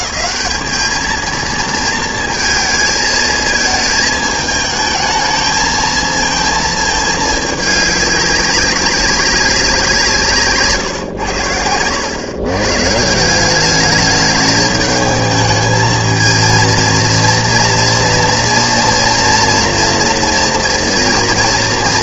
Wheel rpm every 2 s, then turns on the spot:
210, 220, 220, 220, 190, 110, 170, 220, 230, 230, 230.
none